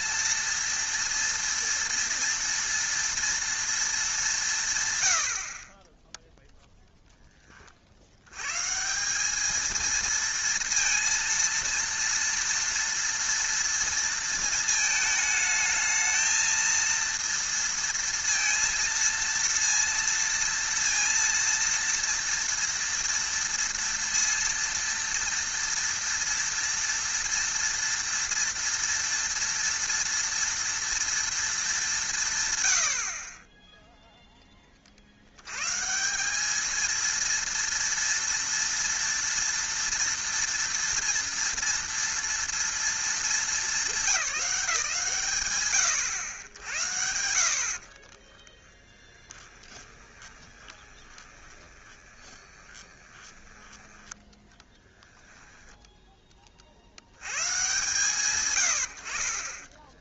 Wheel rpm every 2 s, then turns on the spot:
230, 230, 150, 0, 140, 230, 230, 220, 230, 230, 230, 230, 230, 230, 230, 230, 100, 20, 220, 230, 240, 230, 160, 90, 20, 20, 20, 10, 60, 90.
48-54